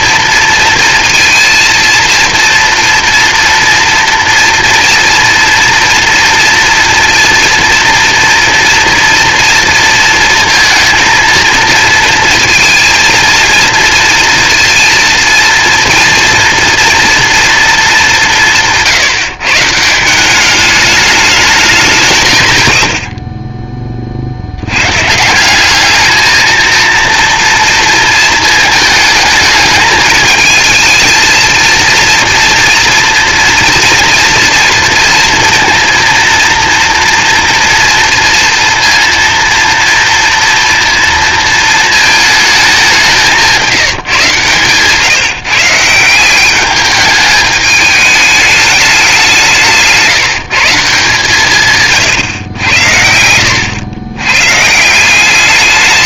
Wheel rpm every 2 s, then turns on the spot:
230, 230, 230, 230, 230, 230, 230, 230, 230, 160, 210, 90, 100, 230, 220, 220, 240, 230, 230, 230, 230, 200, 130, 200, 210, 160, 100, 150.
44-46